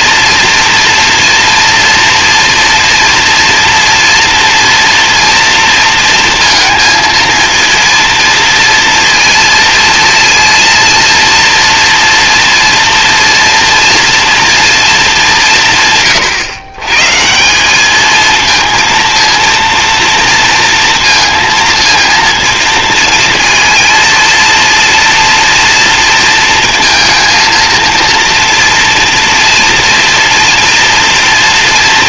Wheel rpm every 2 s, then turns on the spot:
230, 240, 230, 230, 230, 230, 230, 230, 130, 220, 230, 230, 230, 230, 230, 230.
none